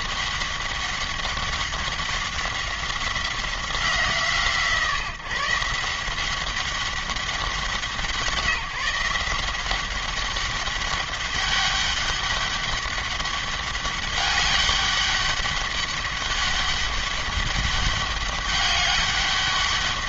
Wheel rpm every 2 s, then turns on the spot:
200, 190, 150, 190, 180, 200, 200, 200, 200, 200.
none